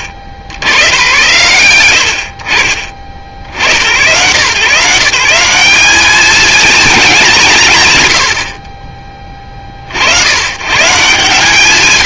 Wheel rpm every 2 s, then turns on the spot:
70, 50, 150, 210, 50, 140.
none